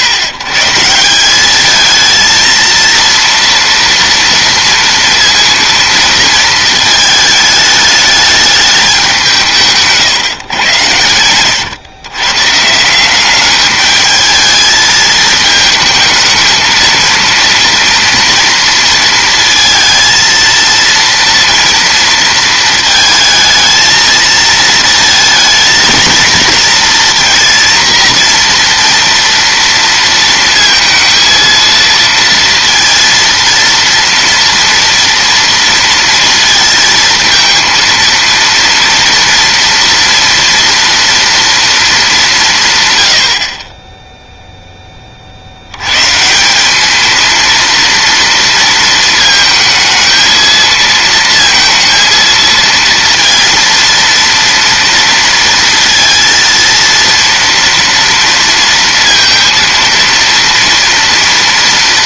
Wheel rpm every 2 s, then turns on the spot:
140, 230, 230, 220, 210, 120, 150, 220, 220, 230, 230, 220, 220, 230, 240, 230, 230, 230, 230, 230, 230, 170, 0, 190, 230, 220, 220, 230, 230, 230, 230.
none